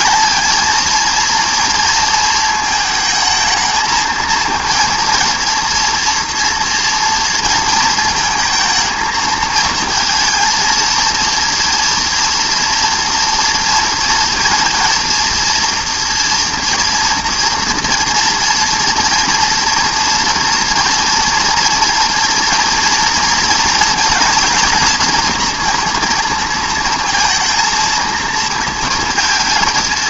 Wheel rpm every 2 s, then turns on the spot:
220, 220, 230, 230, 220, 230, 230, 230, 230, 230, 230, 230, 230, 220, 230.
none